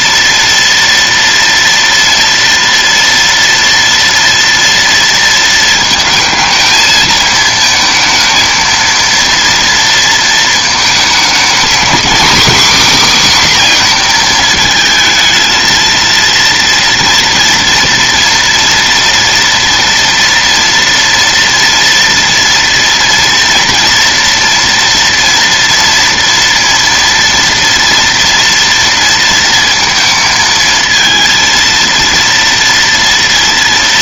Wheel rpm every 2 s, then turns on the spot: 230, 230, 230, 220, 230, 220, 270, 230, 230, 230, 230, 230, 230, 230, 230, 230, 230.
none